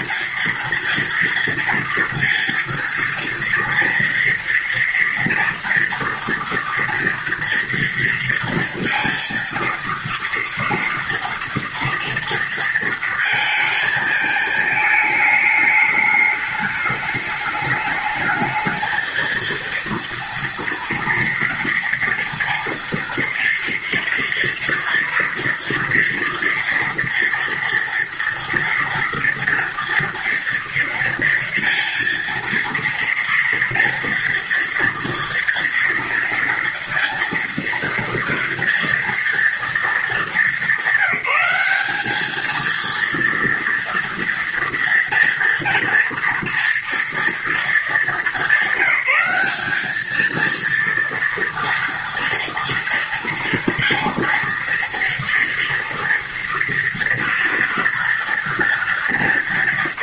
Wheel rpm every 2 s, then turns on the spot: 230, 230, 230, 230, 230, 230, 230, 220, 210, 220, 230, 230, 230, 230, 230, 230, 230, 230, 230, 230, 200, 220, 230, 240, 200, 230, 230, 230, 240, 230.
none